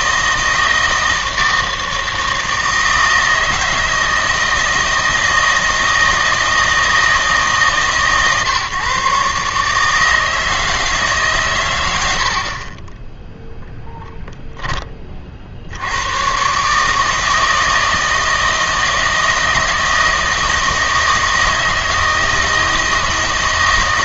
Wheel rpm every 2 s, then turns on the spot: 160, 160, 160, 160, 140, 150, 20, 30, 150, 160, 160, 160.
none